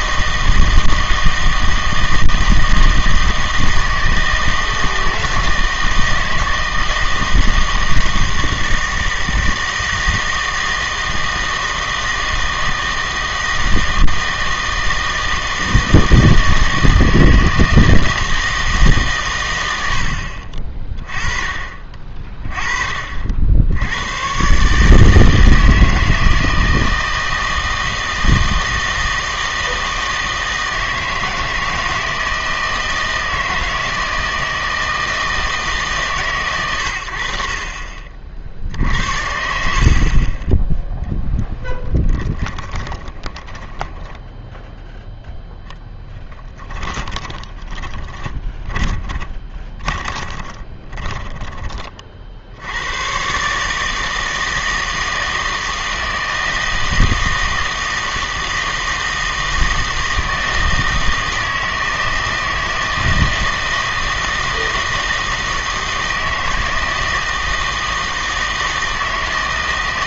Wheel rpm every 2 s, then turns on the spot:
160, 160, 160, 160, 160, 160, 160, 160, 160, 160, 40, 30, 140, 160, 160, 160, 160, 160, 110, 60, 10, 20, 10, 20, 10, 30, 80, 160, 160, 160, 160, 160, 160, 160, 160.
40-44 46-52